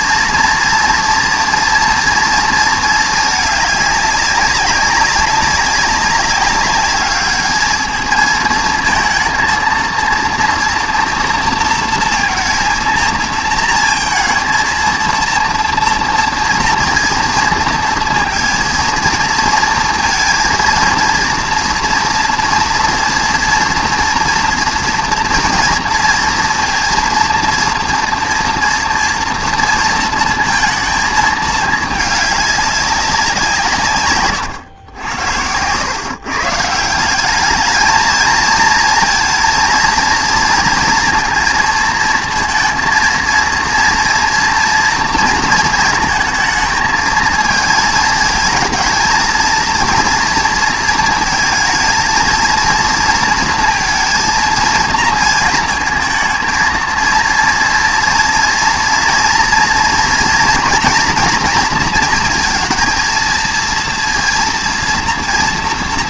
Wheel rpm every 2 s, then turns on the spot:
230, 230, 200, 200, 220, 230, 230, 230, 230, 230, 230, 230, 230, 230, 230, 220, 200, 100, 140, 230, 230, 230, 230, 220, 220, 230, 220, 230, 230, 230, 240, 230, 230.
none